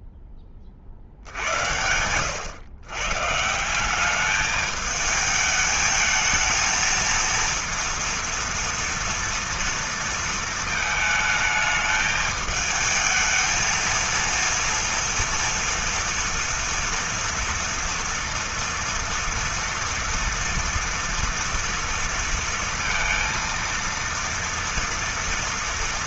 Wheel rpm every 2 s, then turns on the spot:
20, 110, 210, 220, 230, 230, 220, 230, 230, 230, 230, 230, 230.
none